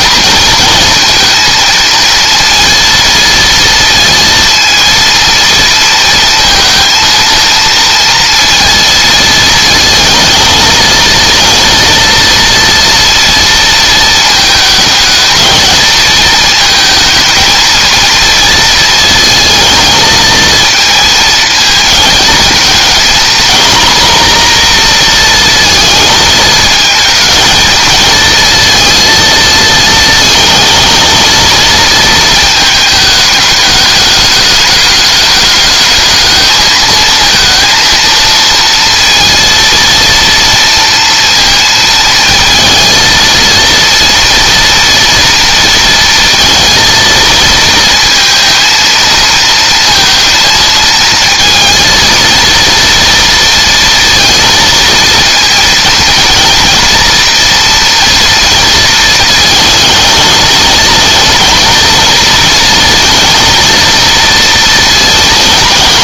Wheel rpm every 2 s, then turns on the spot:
230, 230, 230, 230, 230, 220, 230, 210, 220, 220, 220, 230, 240, 230, 230, 230, 220, 210, 220, 230, 230, 230, 230, 230, 230, 220, 230, 230, 240, 230, 220, 230, 230.
none